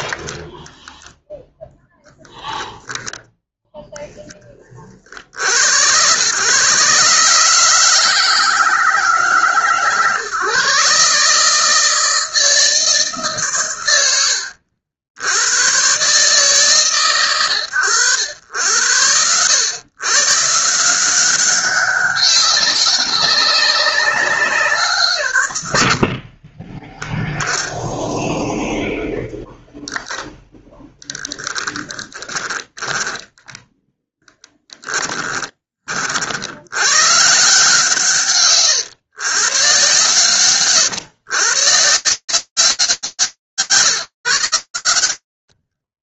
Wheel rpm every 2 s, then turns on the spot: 10, 0, 110, 150, 130, 160, 130, 130, 100, 130, 200, 190, 60, 10, 0, 20, 0, 40, 150, 130, 150, 80, 70.
30-32 44-46